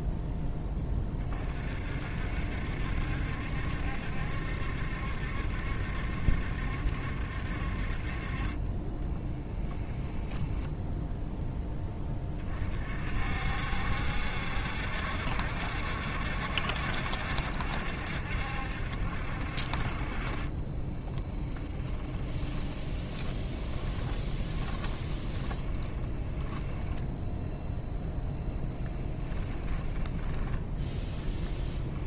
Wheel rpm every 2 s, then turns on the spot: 20, 70, 70, 70, 20, 0, 40, 70, 70, 70, 20, 20, 20, 10, 10, 10.
8-10 20-28